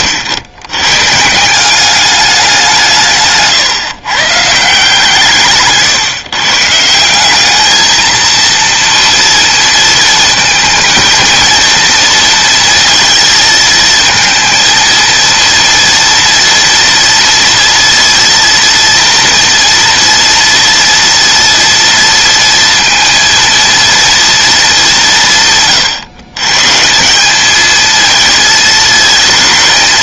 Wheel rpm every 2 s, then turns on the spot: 120, 170, 150, 150, 230, 230, 230, 230, 230, 230, 230, 230, 200, 150, 220.
none